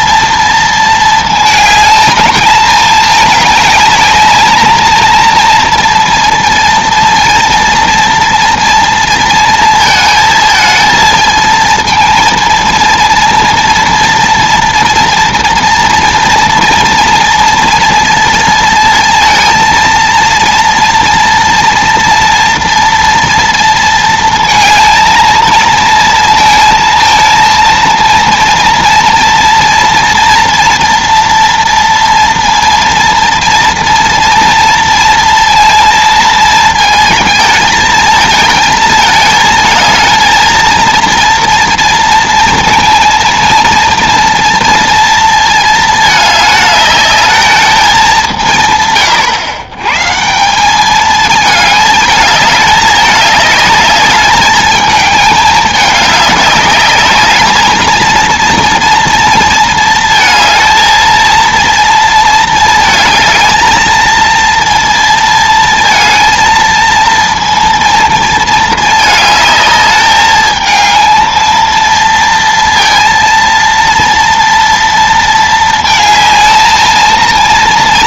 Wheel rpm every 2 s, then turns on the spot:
230, 220, 220, 230, 230, 220, 230, 230, 230, 230, 230, 230, 230, 230, 230, 230, 230, 230, 220, 220, 230, 230, 230, 210, 160, 180, 210, 210, 210, 230, 220, 220, 230, 220, 220, 220, 230, 230, 220.
none